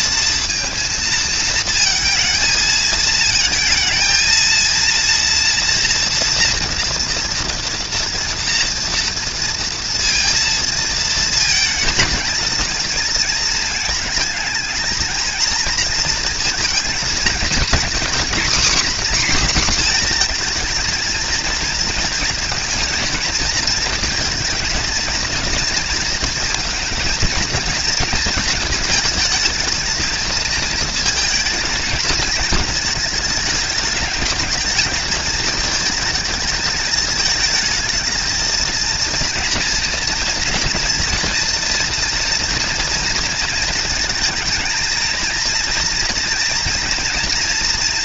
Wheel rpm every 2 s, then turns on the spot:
230, 220, 230, 230, 230, 220, 220, 220, 230, 260, 230, 230, 220, 230, 220, 230, 220, 220, 220, 230, 230, 230, 230, 240.
none